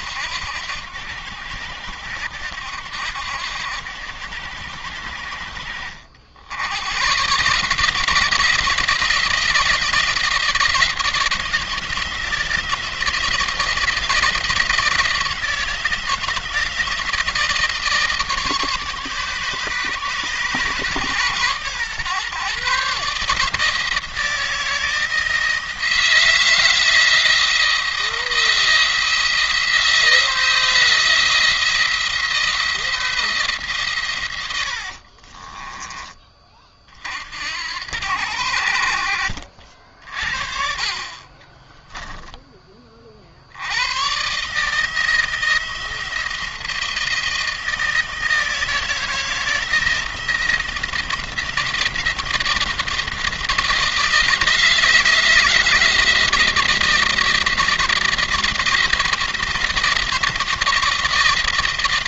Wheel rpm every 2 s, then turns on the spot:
80, 80, 80, 100, 160, 160, 170, 170, 170, 150, 140, 140, 160, 170, 170, 170, 170, 80, 40, 70, 50, 30, 150, 170, 160, 170, 170, 170, 170, 170, 170.
34-36 40-42